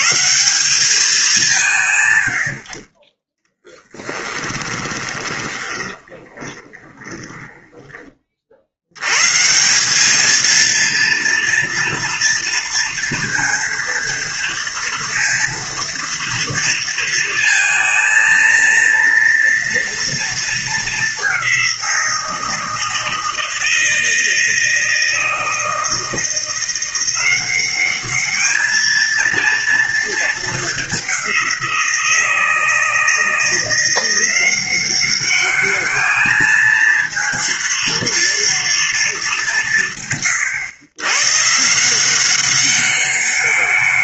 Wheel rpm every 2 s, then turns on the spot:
190, 20, 20, 20, 130, 230, 230, 230, 230, 230, 200, 160, 160, 180, 230, 190, 160, 200, 230, 210, 120, 200.
4-8